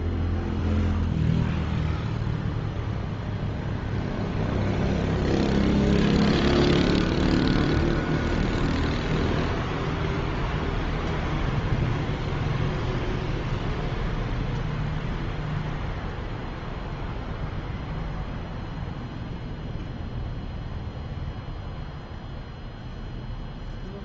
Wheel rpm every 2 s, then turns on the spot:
0, 0, 0, 0, 0, 0, 0, 0, 0, 0, 0, 0.
none